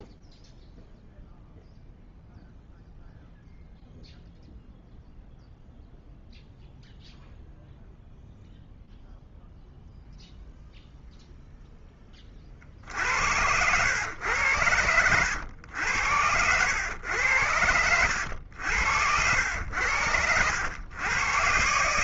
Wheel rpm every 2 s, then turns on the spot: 0, 0, 0, 0, 0, 0, 50, 100, 90, 80, 90.
18-20